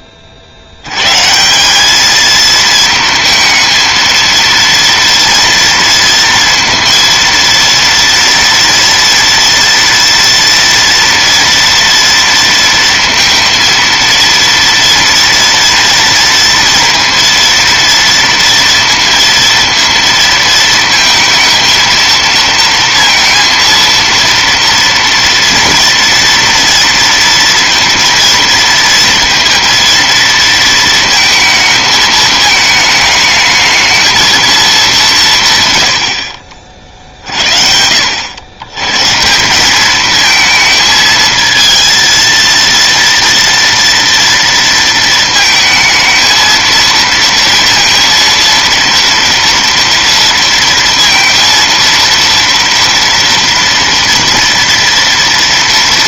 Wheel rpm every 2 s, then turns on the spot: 160, 220, 230, 230, 240, 230, 230, 230, 230, 230, 230, 230, 230, 230, 230, 220, 220, 130, 60, 160, 230, 230, 230, 230, 230, 230, 230, 230.
none